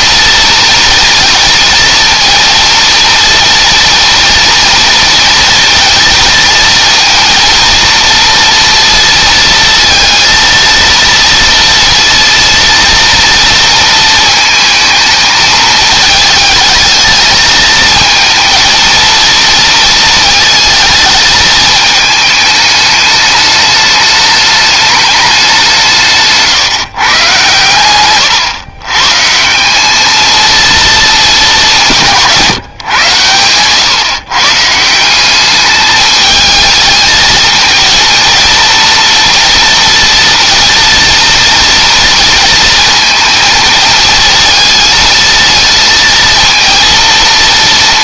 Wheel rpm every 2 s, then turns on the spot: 230, 230, 230, 230, 230, 230, 230, 220, 220, 230, 220, 210, 210, 130, 130, 220, 130, 170, 220, 230, 230, 230, 220, 230.
none